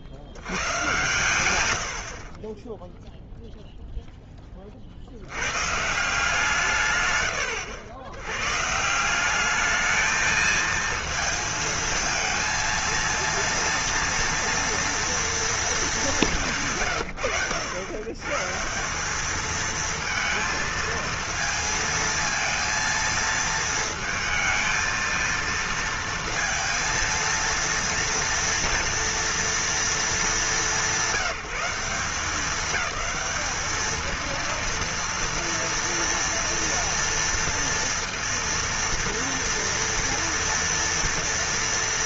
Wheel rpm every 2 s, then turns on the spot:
70, 20, 30, 150, 140, 220, 230, 230, 160, 150, 230, 230, 220, 230, 230, 180, 210, 230, 230, 230, 230.
none